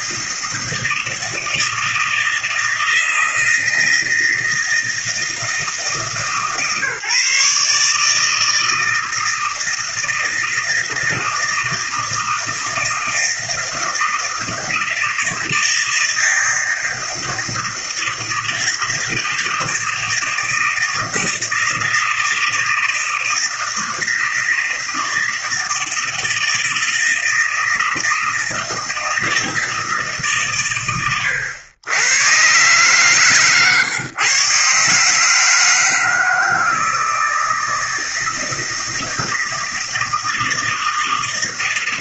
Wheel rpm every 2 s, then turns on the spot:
160, 160, 160, 140, 160, 160, 160, 160, 160, 160, 160, 160, 160, 160, 160, 130, 120, 130, 160, 160, 160.
none